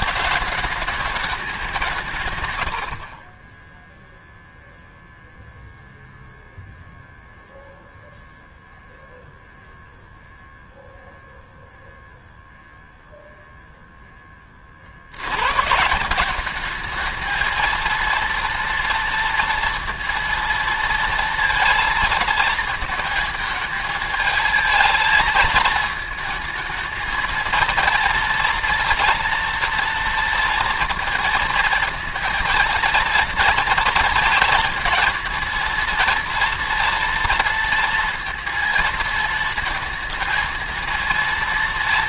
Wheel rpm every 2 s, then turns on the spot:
210, 110, 0, 0, 0, 0, 0, 50, 210, 230, 230, 220, 220, 220, 230, 230, 230, 230, 230, 230, 230.
none